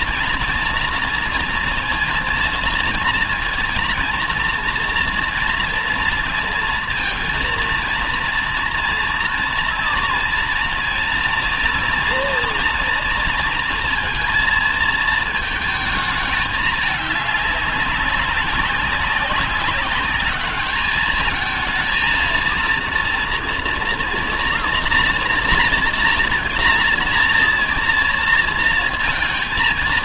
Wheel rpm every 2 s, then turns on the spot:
230, 230, 230, 230, 230, 230, 230, 230, 210, 190, 210, 230, 230, 230, 230.
none